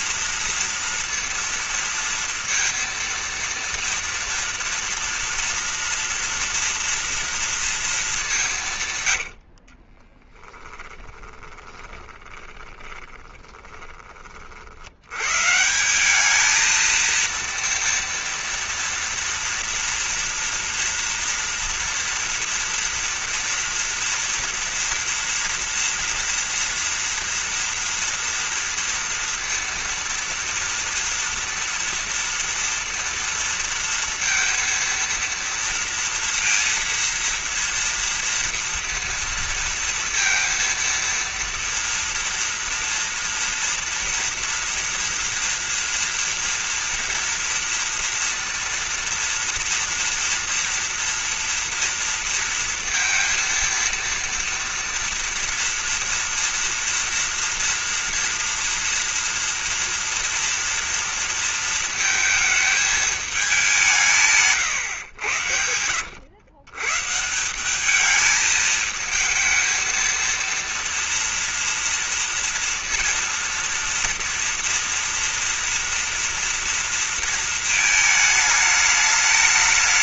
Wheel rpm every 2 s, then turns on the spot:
230, 230, 230, 230, 190, 20, 20, 60, 220, 230, 230, 230, 230, 230, 230, 230, 230, 230, 230, 230, 230, 230, 230, 240, 240, 240, 230, 230, 230, 230, 230, 220, 140, 120, 220, 230, 230, 230, 230, 220.
10-14